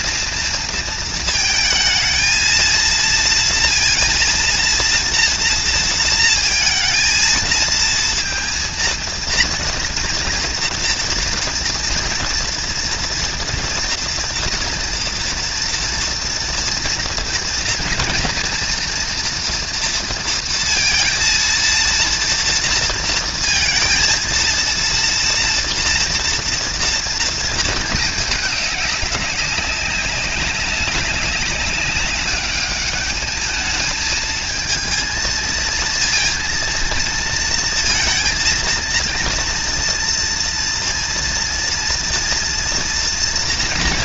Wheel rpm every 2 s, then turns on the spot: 230, 230, 230, 230, 230, 230, 230, 230, 230, 240, 230, 230, 230, 230, 200, 190, 210, 220, 230, 230, 230, 240.
none